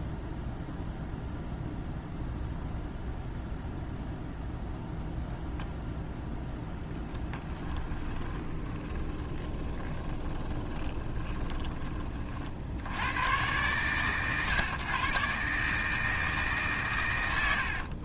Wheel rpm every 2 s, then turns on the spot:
0, 0, 0, 0, 20, 20, 80, 130, 140.
8-12